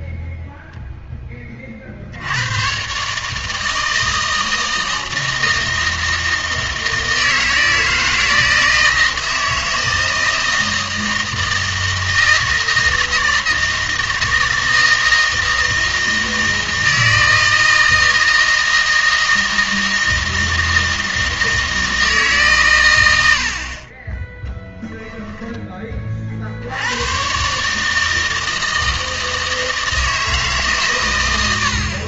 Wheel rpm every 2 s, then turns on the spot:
0, 120, 160, 160, 160, 160, 160, 160, 160, 160, 160, 130, 10, 80, 160, 140.
24-26